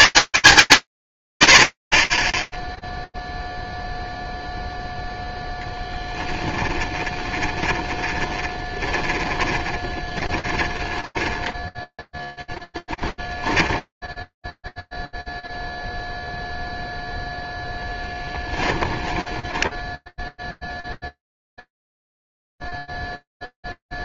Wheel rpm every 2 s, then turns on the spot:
190, 10, 0, 20, 20, 20, 10, 10, 0, 10, 0, 0.
6-14 18-20